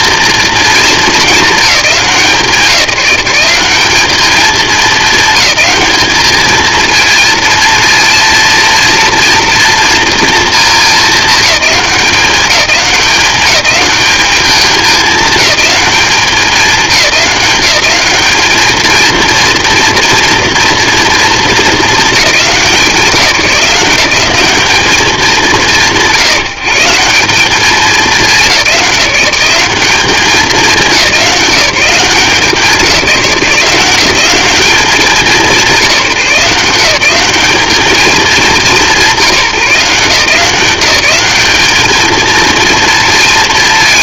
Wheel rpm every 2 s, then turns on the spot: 230, 170, 220, 230, 230, 210, 200, 210, 190, 230, 230, 170, 200, 180, 190, 190, 170, 200, 190, 180, 180, 220.
none